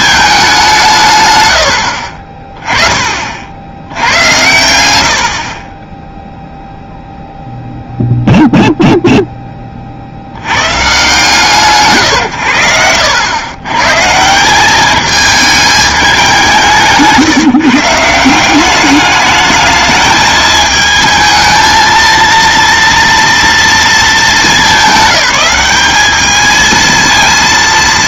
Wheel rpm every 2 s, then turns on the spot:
180, 20, 100, 0, 0, 120, 90, 190, 180, 190, 220, 230, 210, 220.
12-14